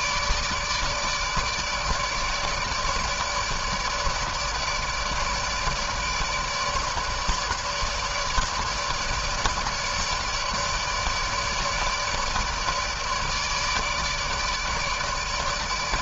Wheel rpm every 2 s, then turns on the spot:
150, 150, 150, 150, 150, 150, 150, 150.
none